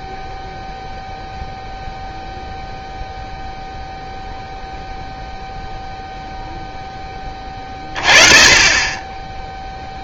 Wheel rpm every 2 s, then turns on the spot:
0, 0, 0, 0, 30.
none